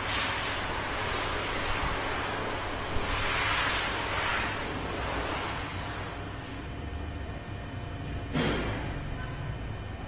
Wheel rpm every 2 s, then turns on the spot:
0, 0, 0, 0, 0.
none